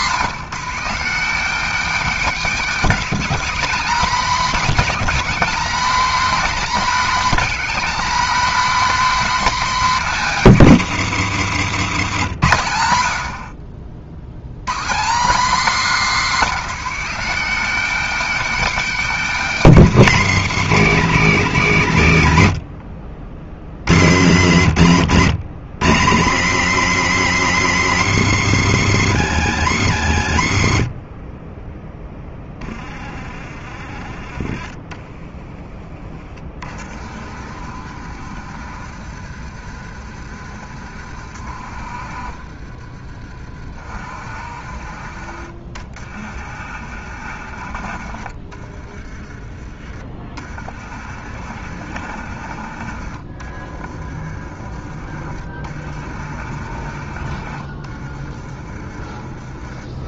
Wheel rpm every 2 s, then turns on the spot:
200, 240, 230, 240, 260, 180, 100, 150, 210, 240, 180, 70, 90, 140, 130, 30, 20, 20, 40, 60, 60, 50, 40, 60, 30, 50, 50, 40, 50, 30.
48-50 58-60